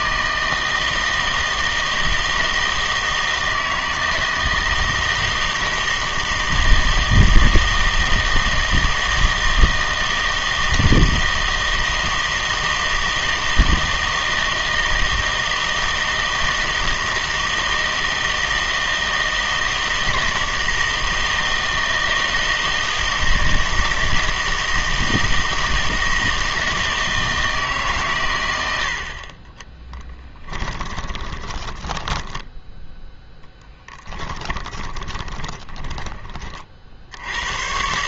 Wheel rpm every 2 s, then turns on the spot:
160, 160, 160, 160, 160, 160, 160, 160, 160, 160, 160, 160, 160, 160, 90, 10, 10, 20, 40.
30-36